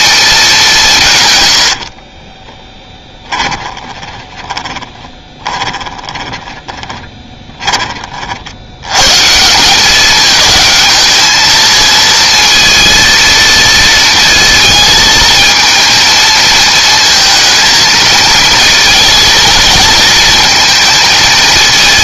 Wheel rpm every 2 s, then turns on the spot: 180, 10, 20, 20, 90, 220, 230, 220, 220, 220, 220.
2-8